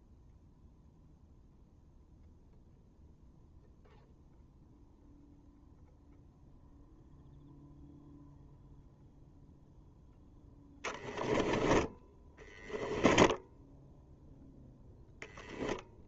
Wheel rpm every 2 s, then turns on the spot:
0, 0, 0, 0, 0, 10, 10, 0.
10-12